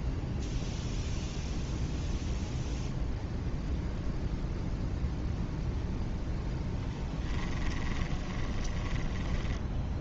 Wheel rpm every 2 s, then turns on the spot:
0, 0, 0, 0, 10.
8-10